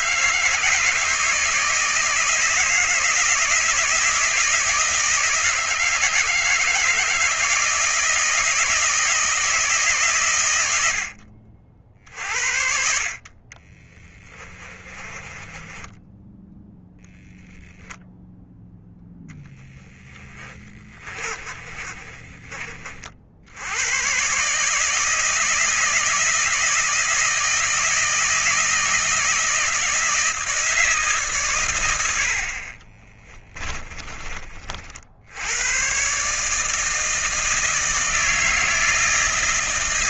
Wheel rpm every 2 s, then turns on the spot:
160, 160, 160, 160, 160, 90, 60, 20, 0, 10, 30, 40, 150, 160, 160, 160, 30, 60, 160, 160.
14-16 20-22 32-34